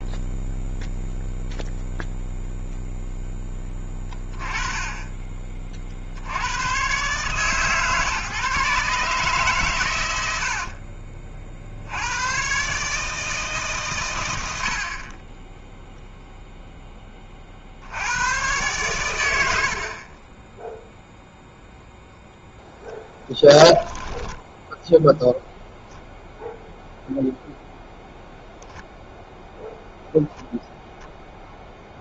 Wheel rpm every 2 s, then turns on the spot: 0, 0, 20, 100, 140, 80, 120, 90, 0, 110, 20, 10, 10, 0, 0, 0.
10-12 24-26